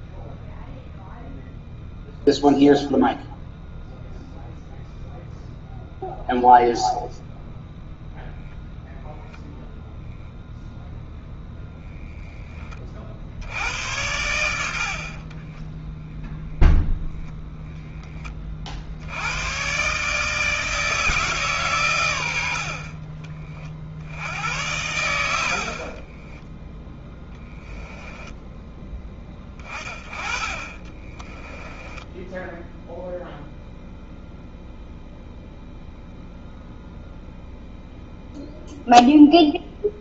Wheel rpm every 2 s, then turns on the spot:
0, 0, 0, 0, 0, 0, 40, 50, 0, 60, 160, 50, 90, 10, 20, 20, 0, 0, 0, 0.
14-16 26-28 30-32